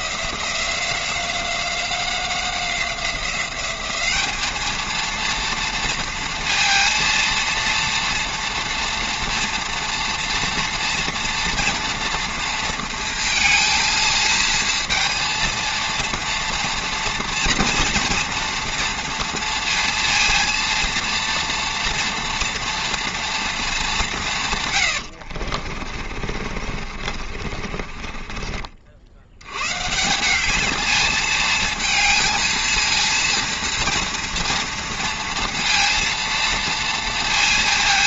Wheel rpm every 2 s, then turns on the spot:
180, 180, 230, 230, 230, 240, 230, 230, 230, 230, 230, 230, 70, 40, 80, 220, 230, 230, 230.
24-28